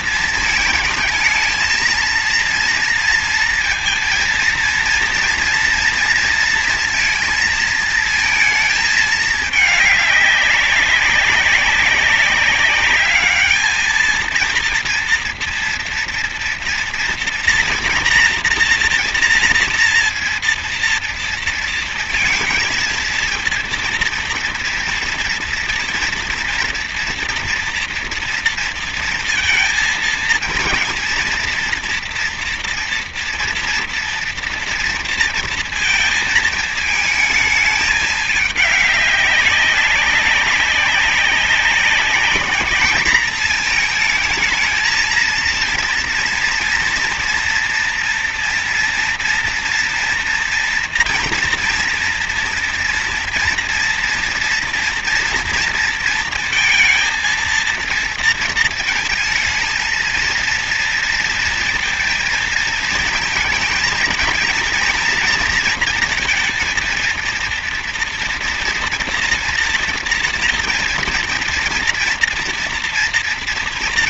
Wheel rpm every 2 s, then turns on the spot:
230, 230, 230, 230, 220, 200, 200, 230, 230, 230, 230, 230, 230, 230, 230, 230, 230, 230, 220, 210, 200, 210, 220, 230, 230, 230, 240, 230, 230, 230, 230, 230, 230, 230, 230, 230, 230.
none